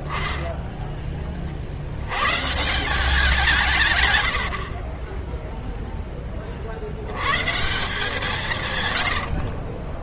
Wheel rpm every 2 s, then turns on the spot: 20, 140, 80, 30, 160.
0-2